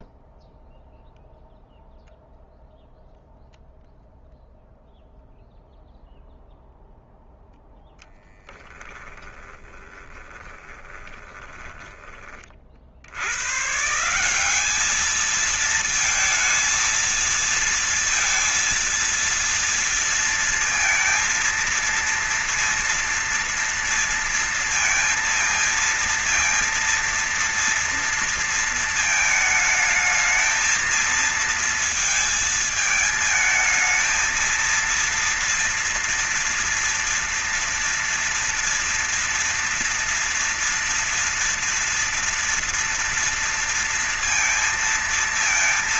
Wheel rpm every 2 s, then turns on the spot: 0, 0, 0, 0, 10, 20, 60, 200, 220, 230, 230, 230, 230, 230, 230, 220, 220, 230, 230, 230, 230, 230, 230.
8-12